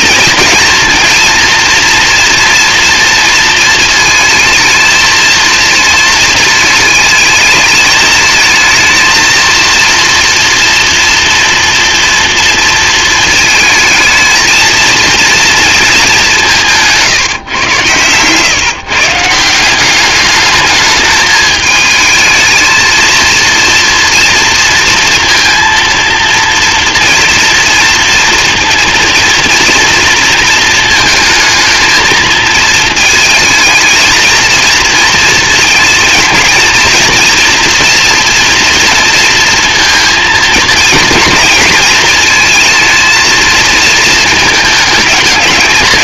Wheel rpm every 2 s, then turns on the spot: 230, 230, 220, 220, 220, 230, 230, 230, 160, 150, 210, 220, 230, 230, 230, 220, 220, 230, 230, 230, 220, 220, 220.
16-18